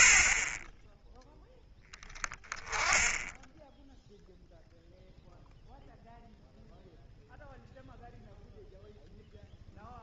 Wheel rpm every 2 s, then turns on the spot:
10, 10, 0, 0, 0.
none